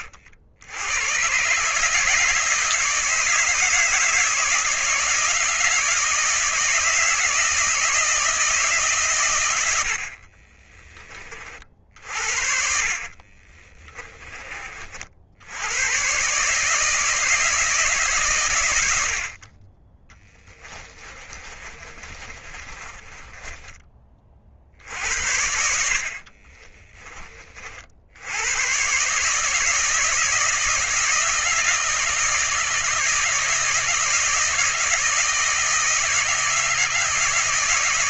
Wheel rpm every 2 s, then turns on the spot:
90, 160, 160, 160, 150, 30, 50, 40, 160, 90, 20, 30, 60, 20, 120, 160, 160, 160, 160.
12-14 20-24 26-28